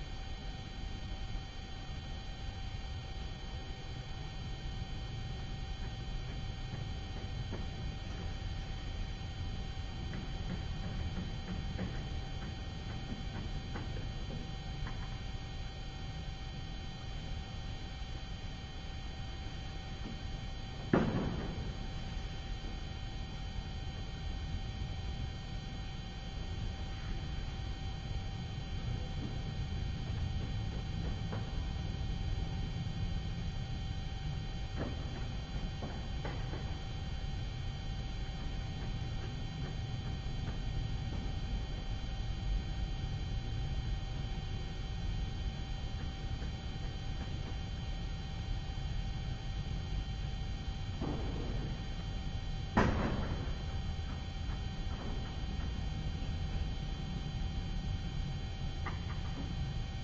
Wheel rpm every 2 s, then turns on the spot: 0, 0, 0, 0, 0, 0, 0, 0, 0, 0, 0, 0, 0, 0, 0, 0, 0, 0, 0, 0, 0, 0, 0, 0, 0, 0, 0, 0, 0, 0.
none